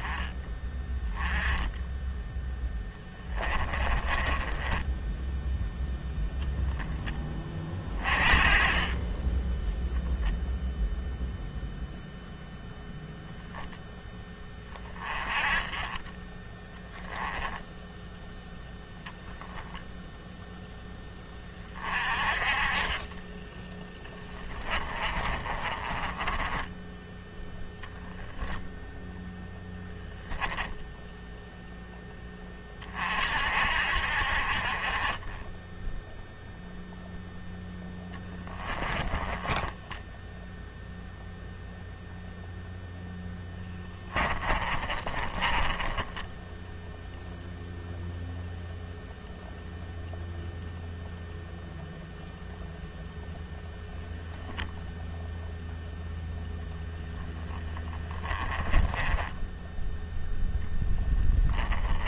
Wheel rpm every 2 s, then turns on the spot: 20, 10, 10, 10, 30, 0, 0, 20, 10, 0, 10, 30, 30, 10, 10, 10, 40, 30, 0, 20, 0, 0, 30, 0, 0, 0, 0, 0, 20, 20, 0.
2-6 16-18 24-32 38-40 44-46 56-60